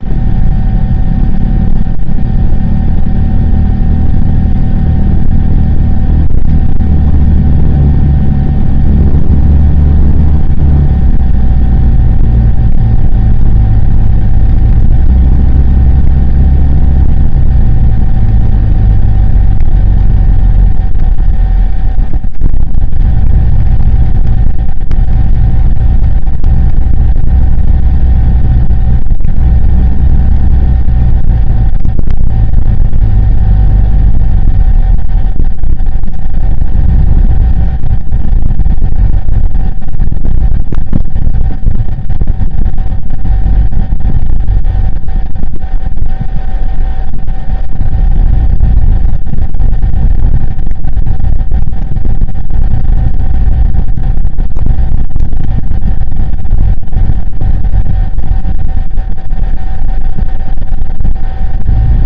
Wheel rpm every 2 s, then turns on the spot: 0, 0, 0, 0, 0, 0, 0, 0, 0, 0, 0, 0, 0, 0, 0, 0, 0, 0, 0, 0, 0, 0, 0, 0, 0, 0, 0, 0, 0, 0, 0.
none